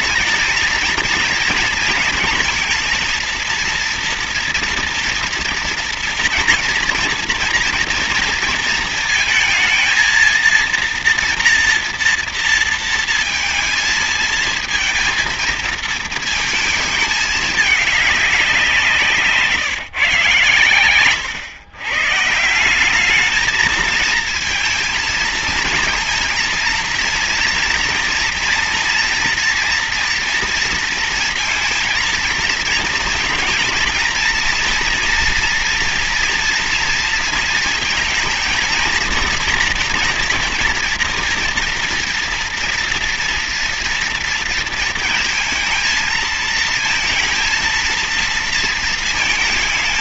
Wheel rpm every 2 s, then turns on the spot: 230, 230, 240, 230, 230, 230, 230, 230, 220, 180, 110, 170, 230, 230, 230, 230, 230, 230, 230, 230, 230, 230, 230, 230, 230.
none